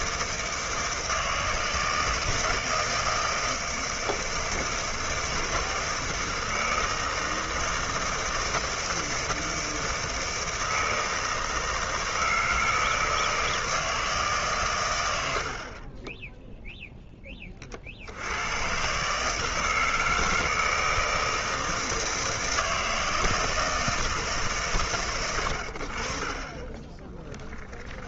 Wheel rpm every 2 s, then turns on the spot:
160, 160, 160, 160, 160, 160, 160, 130, 0, 110, 160, 160, 140, 20.
26-28